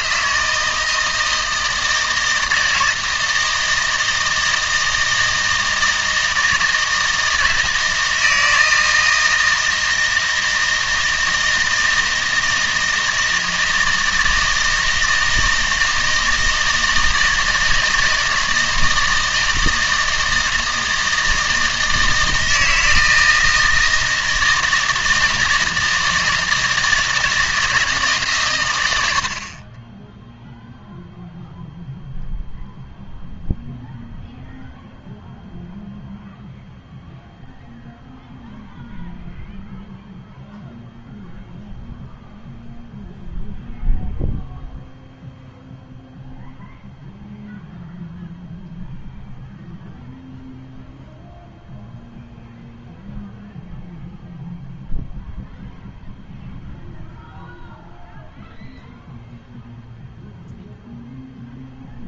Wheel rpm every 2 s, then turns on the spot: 160, 160, 160, 160, 160, 160, 160, 160, 160, 160, 160, 160, 160, 160, 100, 0, 0, 0, 0, 0, 0, 0, 0, 0, 0, 0, 0, 0, 0, 0, 0.
none